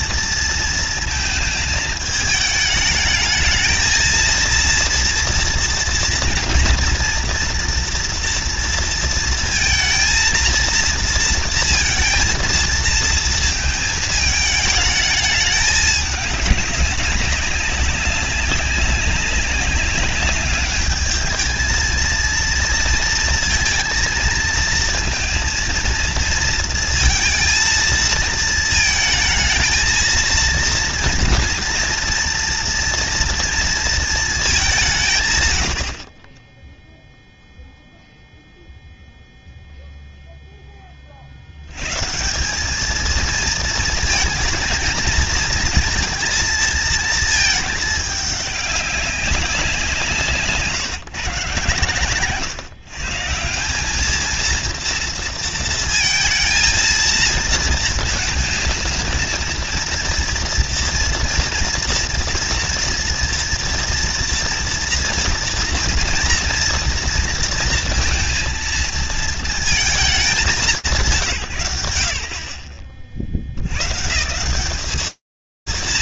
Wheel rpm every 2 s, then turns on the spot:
230, 210, 230, 240, 230, 230, 230, 220, 200, 190, 210, 230, 230, 230, 230, 230, 230, 180, 0, 0, 20, 210, 230, 230, 200, 150, 140, 230, 230, 230, 230, 230, 230, 230, 230, 160, 60, 180.
none